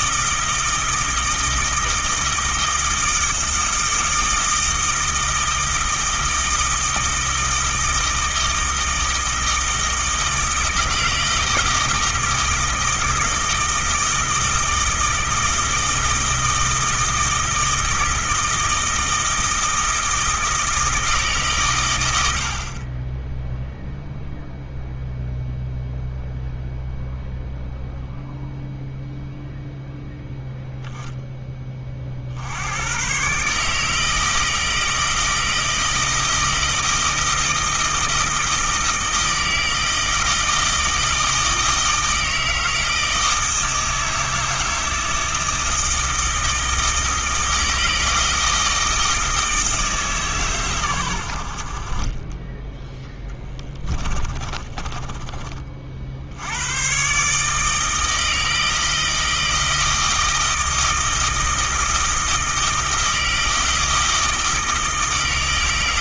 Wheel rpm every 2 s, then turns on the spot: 160, 160, 160, 160, 160, 160, 160, 160, 160, 160, 160, 30, 0, 0, 0, 0, 100, 160, 160, 160, 160, 160, 160, 160, 160, 110, 10, 20, 120, 160, 160, 160, 160.
54-56